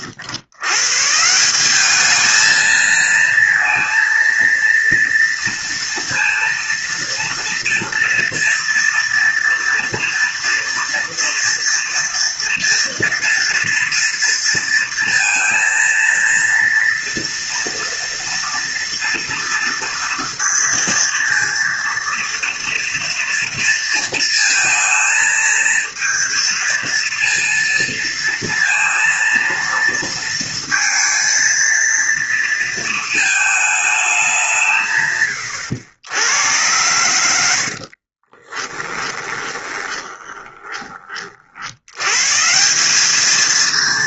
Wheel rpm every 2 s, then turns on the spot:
130, 230, 230, 230, 230, 230, 230, 230, 230, 230, 230, 230, 230, 230, 230, 230, 220, 140, 100, 30, 30, 190.
38-40